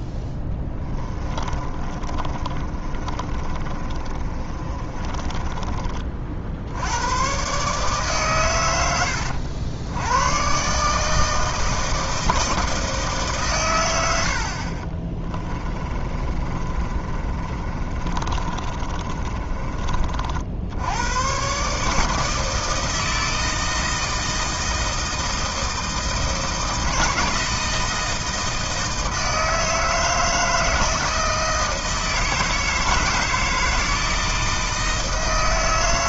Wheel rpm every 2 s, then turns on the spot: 20, 30, 30, 90, 100, 140, 160, 40, 30, 30, 90, 160, 160, 160, 160, 160, 160, 160.
0-6 14-20